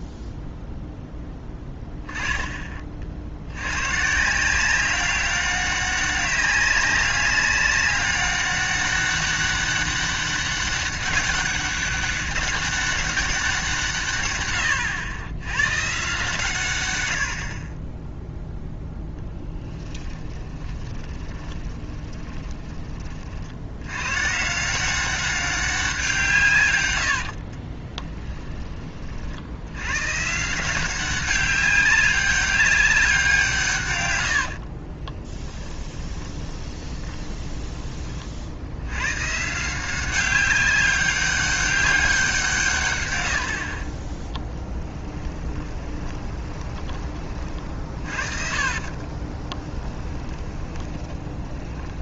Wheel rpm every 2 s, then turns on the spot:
0, 20, 180, 200, 200, 200, 200, 110, 110, 0, 20, 20, 170, 120, 20, 170, 190, 40, 20, 80, 200, 140, 30, 20, 40, 20.
20-22 34-38 44-52